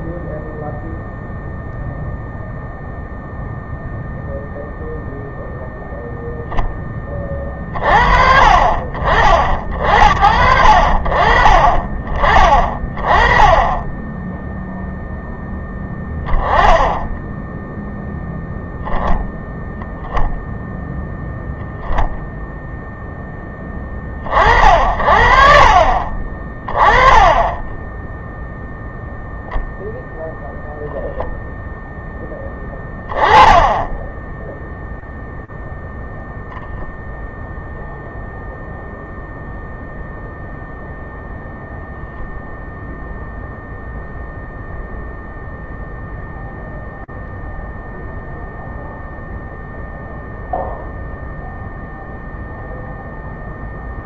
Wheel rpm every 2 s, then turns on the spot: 0, 0, 0, 10, 40, 60, 30, 0, 10, 0, 0, 10, 50, 20, 0, 0, 20, 0, 0, 0, 0, 0, 0, 0, 0, 0, 0.
26-28